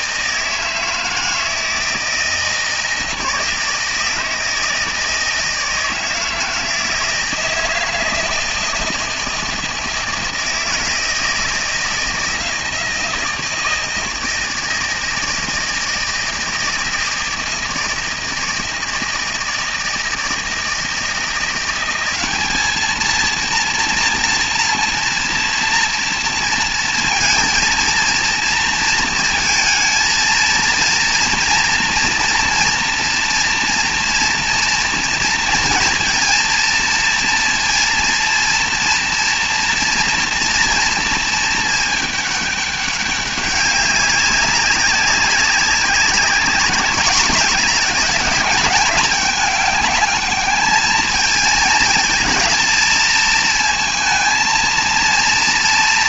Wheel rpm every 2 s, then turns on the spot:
160, 160, 160, 160, 160, 160, 160, 160, 160, 160, 160, 210, 230, 230, 230, 230, 240, 230, 230, 230, 230, 200, 190, 200, 210, 210, 220, 230.
none